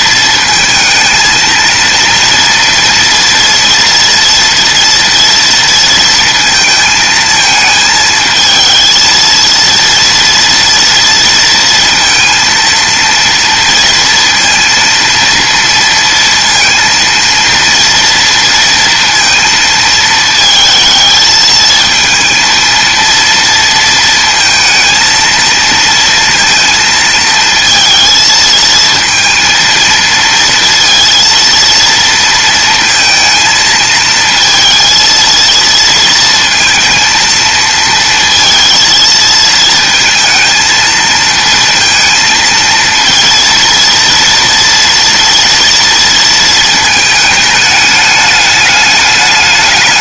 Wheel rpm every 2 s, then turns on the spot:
220, 230, 230, 230, 220, 230, 230, 230, 230, 230, 220, 230, 230, 220, 230, 230, 230, 230, 230, 230, 220, 230, 230, 220, 210.
none